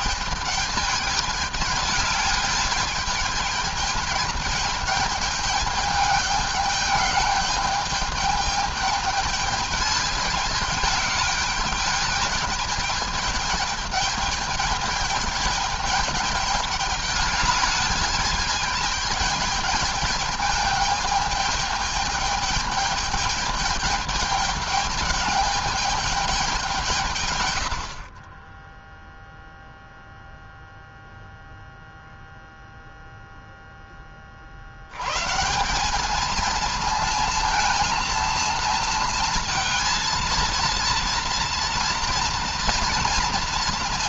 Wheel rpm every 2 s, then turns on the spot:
210, 210, 220, 210, 210, 210, 210, 210, 210, 210, 210, 210, 210, 180, 10, 0, 0, 60, 230, 230, 230, 230.
none